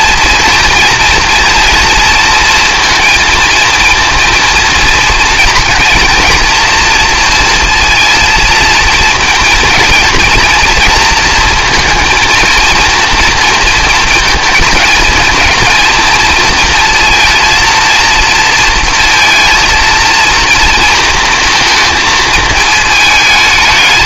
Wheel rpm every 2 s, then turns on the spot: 230, 230, 230, 230, 230, 230, 230, 220, 230, 230, 230, 220.
none